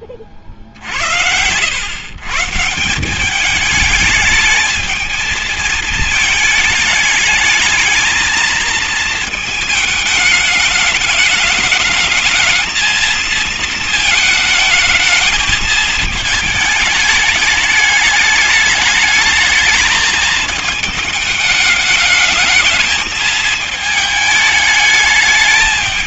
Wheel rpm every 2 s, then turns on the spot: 50, 170, 220, 220, 230, 210, 230, 220, 220, 210, 220, 220, 210.
none